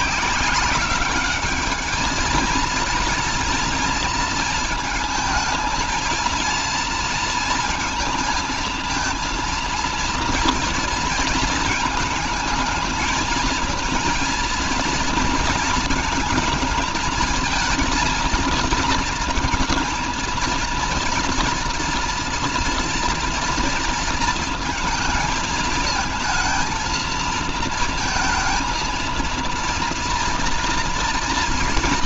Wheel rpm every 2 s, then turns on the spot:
190, 230, 230, 230, 220, 230, 220, 230, 220, 230, 230, 230, 220, 230, 230, 230.
none